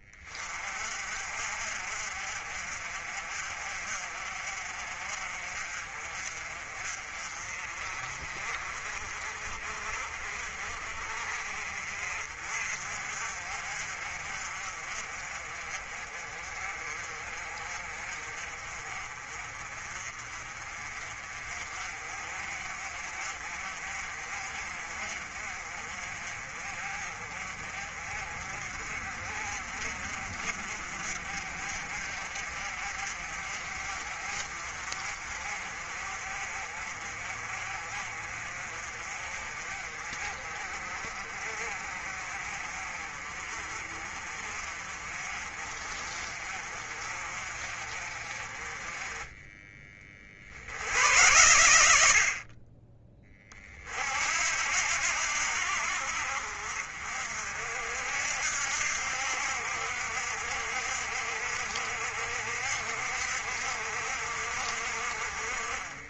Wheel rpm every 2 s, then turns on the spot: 40, 50, 50, 40, 40, 40, 50, 40, 40, 40, 40, 40, 40, 40, 40, 50, 50, 50, 40, 40, 40, 40, 40, 40, 20, 90, 20, 70, 50, 70, 60, 60, 50.
none